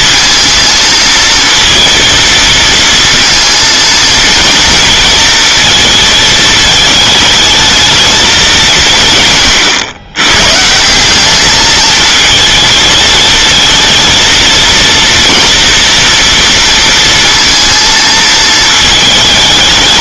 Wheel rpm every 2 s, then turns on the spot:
230, 230, 230, 220, 180, 160, 220, 230, 230, 220.
none